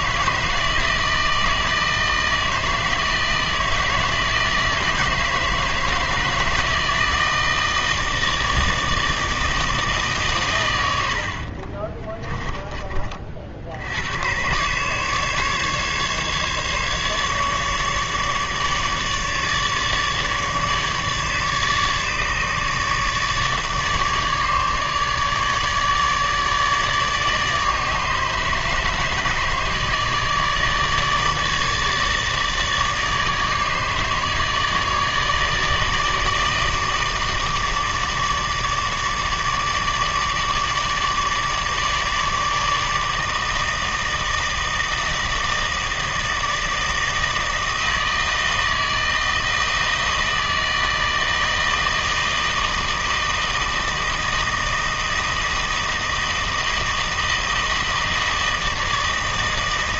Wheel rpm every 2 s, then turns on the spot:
160, 160, 160, 160, 160, 110, 20, 120, 150, 150, 150, 150, 150, 150, 150, 160, 150, 160, 150, 150, 150, 160, 160, 160, 160, 160, 160, 160, 160, 160.
none